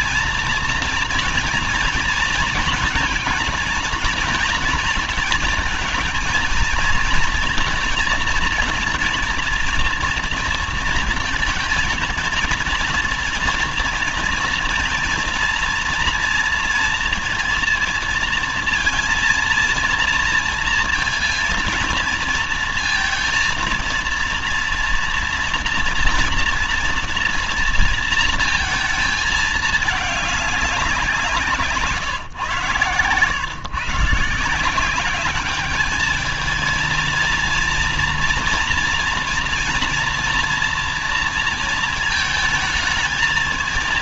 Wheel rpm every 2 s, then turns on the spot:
230, 230, 230, 220, 230, 230, 230, 230, 230, 230, 230, 230, 230, 230, 230, 200, 130, 160, 220, 240, 230, 220.
none